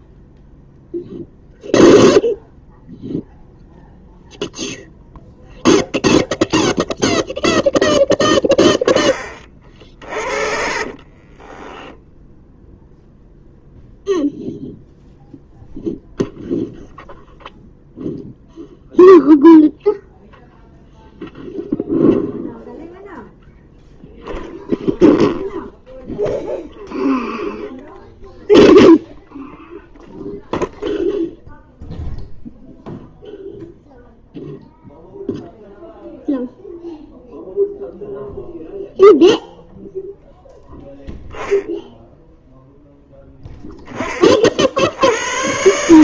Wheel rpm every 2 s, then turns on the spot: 0, 0, 0, 0, 20, 40, 0, 0, 0, 0, 0, 0, 0, 0, 0, 0, 0, 0, 0, 0, 0, 0, 70.
10-12